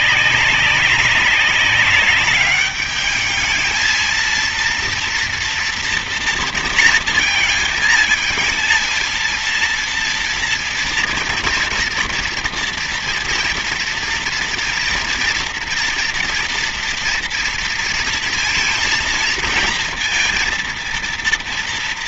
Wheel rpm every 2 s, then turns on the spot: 200, 200, 230, 230, 230, 230, 230, 230, 230, 230, 230.
none